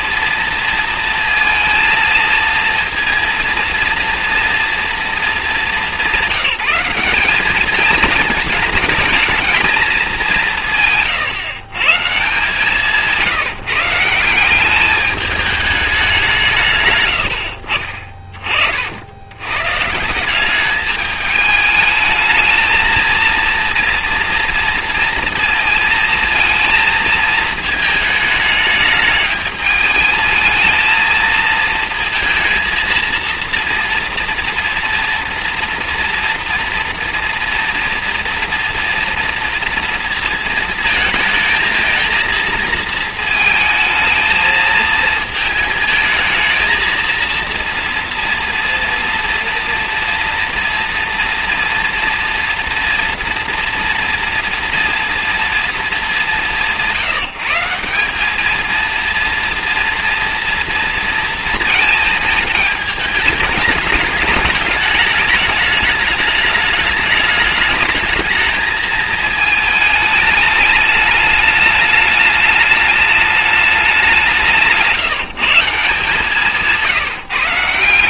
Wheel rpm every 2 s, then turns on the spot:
230, 230, 230, 190, 220, 130, 170, 210, 100, 80, 210, 230, 230, 220, 210, 220, 230, 230, 230, 230, 220, 220, 220, 230, 240, 230, 230, 230, 170, 230, 230, 210, 210, 210, 220, 210, 210, 160, 160.
10-12